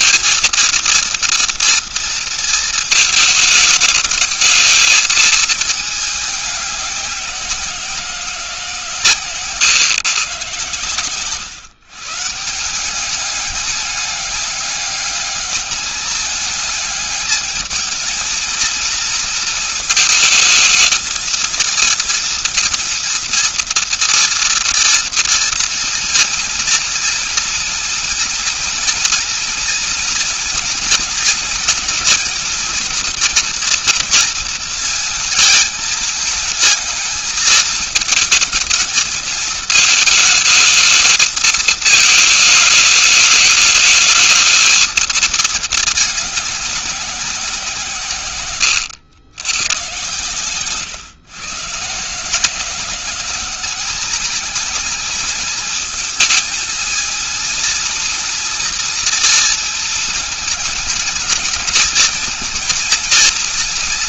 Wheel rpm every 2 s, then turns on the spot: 230, 230, 220, 210, 170, 120, 160, 200, 210, 230, 220, 230, 230, 230, 230, 230, 220, 230, 220, 220, 220, 220, 220, 210, 120, 130, 160, 220, 220, 230, 220, 230.
48-50